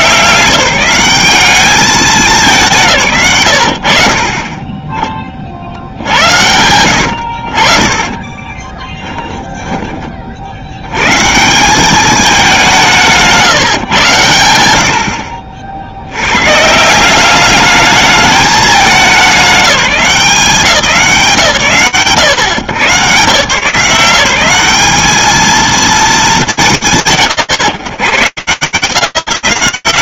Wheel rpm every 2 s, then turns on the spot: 170, 170, 30, 90, 10, 120, 170, 70, 170, 200, 150, 100, 200, 160, 10.
6-10